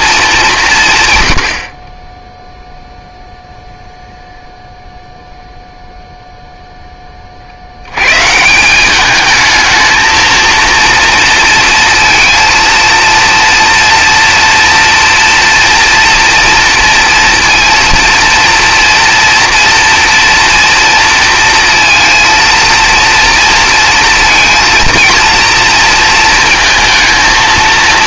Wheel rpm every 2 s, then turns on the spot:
150, 0, 0, 10, 190, 230, 230, 230, 230, 230, 230, 230, 230, 220.
none